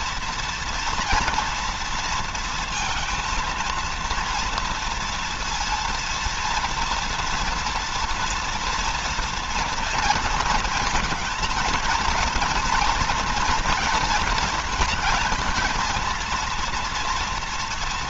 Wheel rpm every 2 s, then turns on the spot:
240, 230, 230, 230, 230, 230, 230, 220, 230.
none